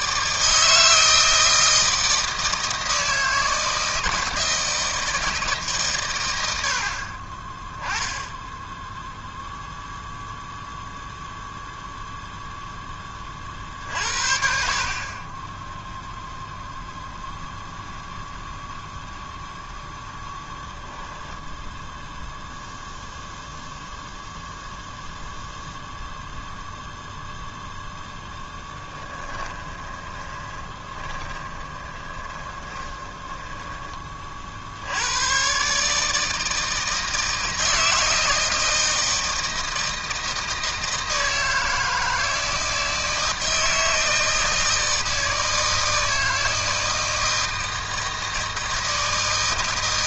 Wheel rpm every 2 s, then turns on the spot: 160, 160, 160, 90, 10, 0, 0, 60, 0, 0, 0, 0, 0, 0, 10, 20, 20, 40, 160, 160, 160, 160, 160, 160, 160.
14-16 28-34